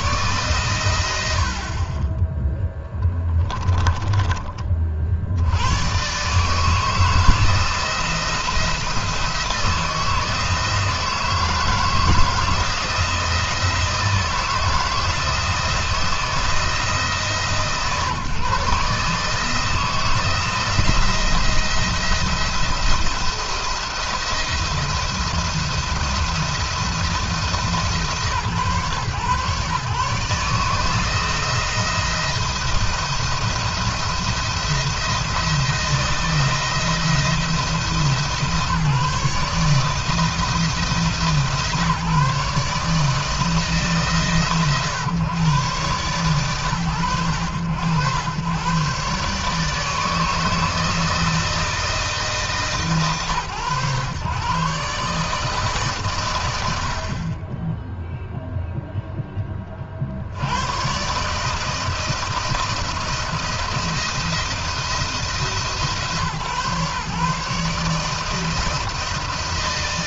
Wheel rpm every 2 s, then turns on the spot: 100, 10, 40, 150, 170, 160, 160, 160, 160, 140, 170, 170, 170, 170, 130, 160, 170, 170, 170, 160, 160, 150, 130, 100, 130, 160, 130, 140, 70, 0, 110, 170, 170, 150, 160.
2-4